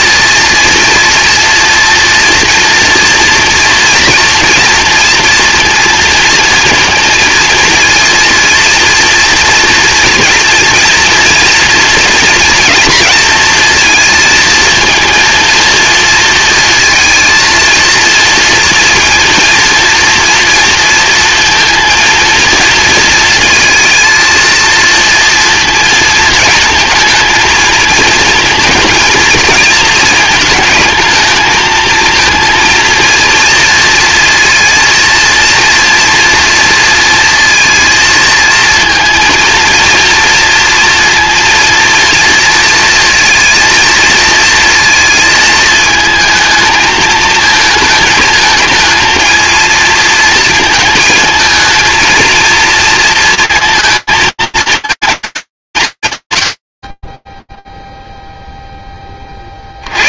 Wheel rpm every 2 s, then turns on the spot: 230, 230, 230, 230, 230, 230, 230, 230, 230, 230, 230, 230, 230, 230, 220, 220, 230, 230, 230, 230, 230, 230, 230, 220, 220, 220, 230, 220, 70, 0.
none